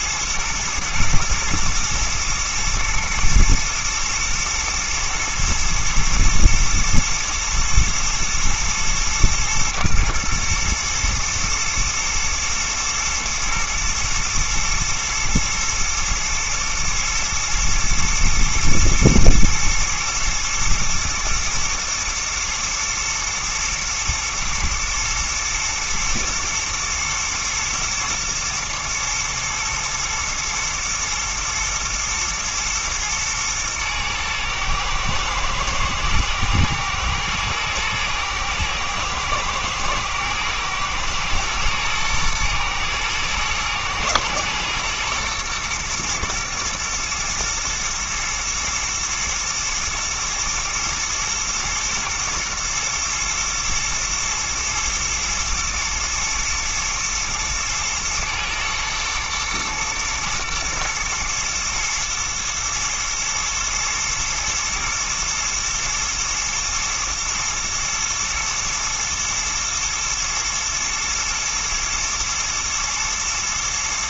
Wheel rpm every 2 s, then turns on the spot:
110, 110, 110, 110, 110, 110, 120, 120, 110, 110, 120, 110, 120, 110, 120, 120, 120, 110, 110, 110, 120, 110, 120, 120, 110, 110, 120, 110, 110, 110, 120, 110, 110, 110, 110, 110, 120.
none